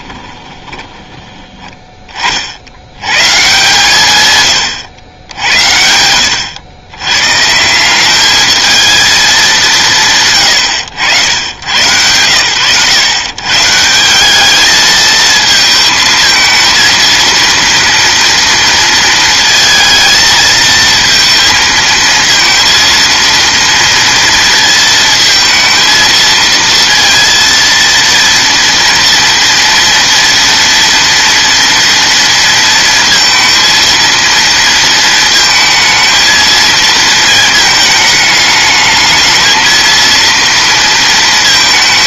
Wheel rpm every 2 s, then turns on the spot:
10, 90, 110, 100, 220, 90, 110, 220, 230, 230, 220, 230, 230, 230, 240, 230, 230, 230, 230, 210, 230.
0-2